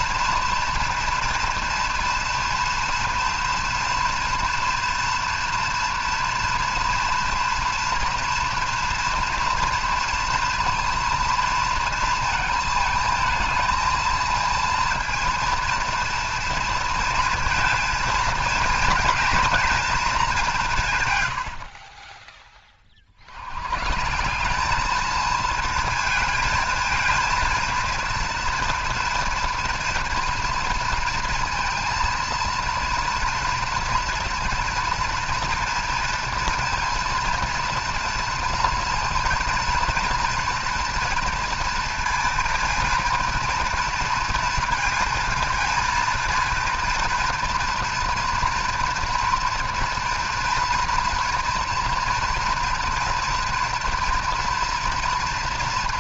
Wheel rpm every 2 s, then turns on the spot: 230, 230, 230, 230, 230, 230, 220, 230, 230, 230, 190, 30, 200, 220, 230, 230, 230, 230, 230, 230, 230, 230, 230, 230, 230, 230, 230, 230.
none